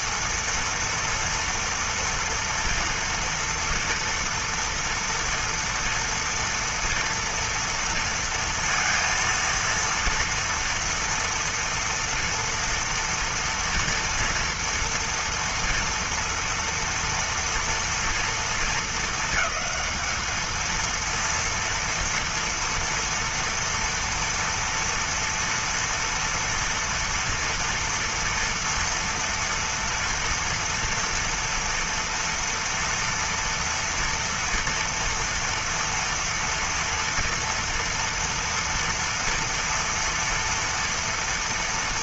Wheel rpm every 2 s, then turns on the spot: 230, 240, 230, 230, 230, 230, 230, 230, 230, 220, 230, 230, 230, 230, 230, 230, 230, 230, 230, 230, 230.
none